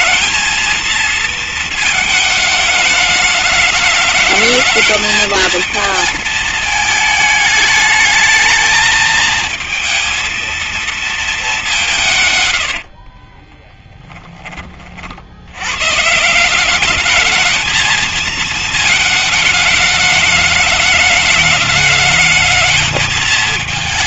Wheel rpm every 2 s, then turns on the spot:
220, 210, 220, 220, 220, 230, 70, 40, 200, 220, 210, 220.
12-14